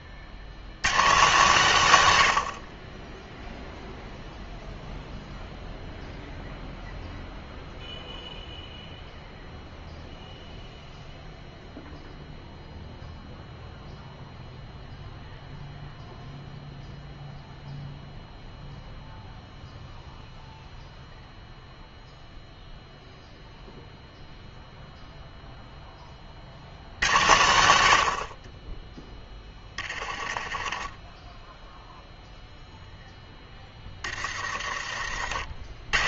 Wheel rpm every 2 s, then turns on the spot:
110, 40, 0, 0, 0, 0, 0, 0, 0, 0, 0, 0, 0, 60, 20, 30, 0, 30.
30-32 34-36